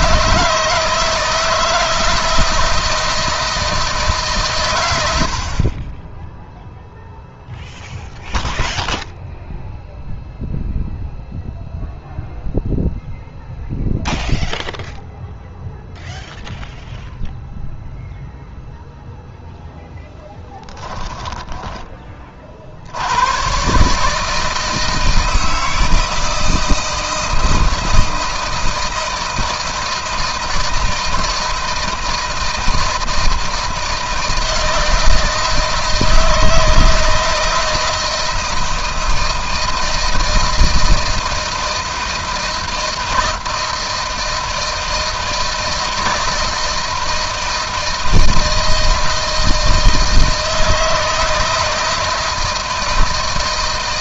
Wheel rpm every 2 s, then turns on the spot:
160, 160, 110, 0, 0, 0, 0, 0, 0, 0, 10, 60, 160, 160, 160, 160, 160, 160, 160, 160, 160, 160, 160, 160, 160, 160, 160.
20-22